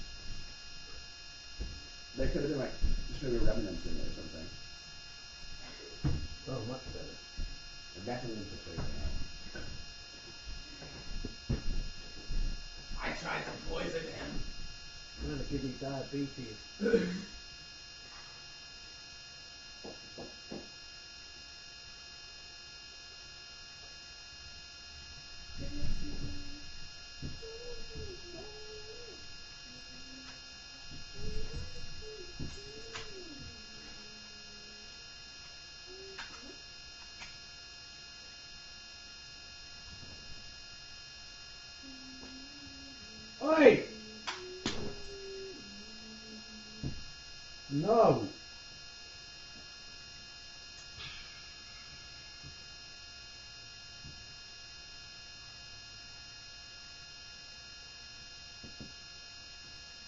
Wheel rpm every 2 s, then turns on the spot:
0, 0, 0, 0, 0, 0, 0, 0, 0, 0, 0, 0, 0, 0, 0, 0, 0, 0, 0, 0, 0, 0, 0, 0, 0, 0, 0, 0, 0, 0.
none